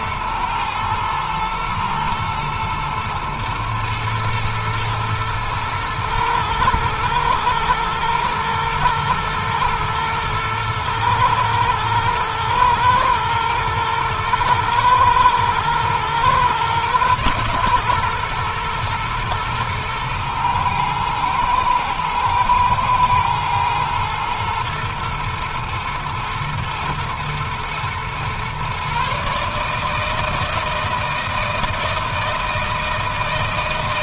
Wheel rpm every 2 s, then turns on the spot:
110, 120, 120, 110, 120, 110, 110, 110, 120, 120, 110, 110, 120, 110, 130, 160, 160.
none